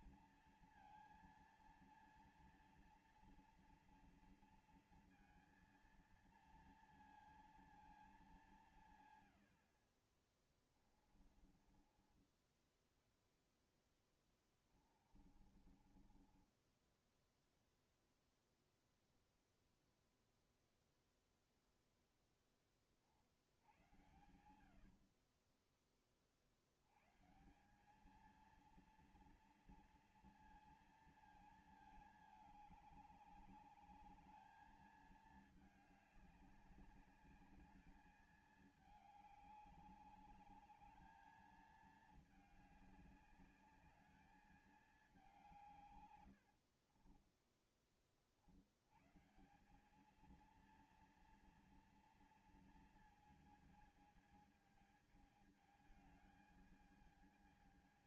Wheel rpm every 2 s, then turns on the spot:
230, 230, 230, 230, 190, 40, 20, 20, 20, 0, 0, 20, 70, 60, 220, 230, 210, 210, 200, 210, 200, 210, 210, 80, 60, 220, 230, 220, 220.
10-12 14-18 24-26 46-48